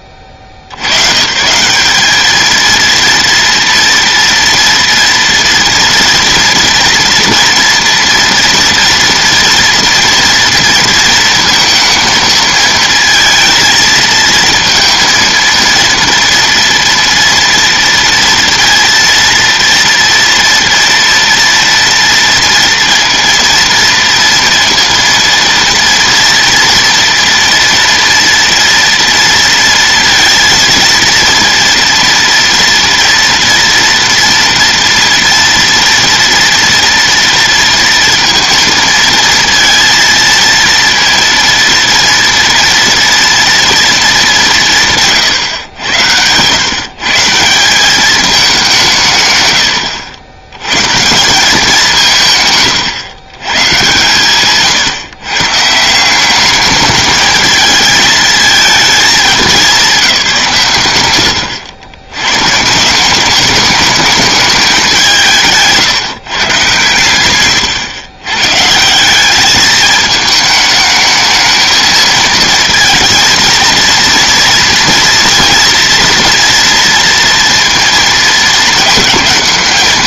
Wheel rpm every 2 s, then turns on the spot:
110, 230, 230, 240, 230, 230, 230, 230, 230, 230, 230, 230, 230, 230, 230, 230, 230, 230, 230, 230, 230, 230, 160, 150, 150, 170, 140, 150, 210, 220, 130, 170, 200, 130, 170, 220, 230, 240, 230, 220.
none